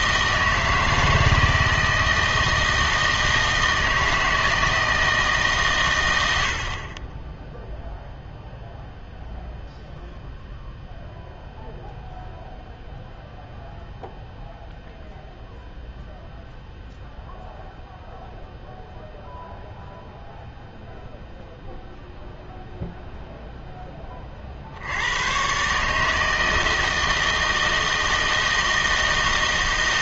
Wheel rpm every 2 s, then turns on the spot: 160, 160, 160, 50, 0, 0, 0, 0, 0, 0, 0, 0, 60, 160, 160.
none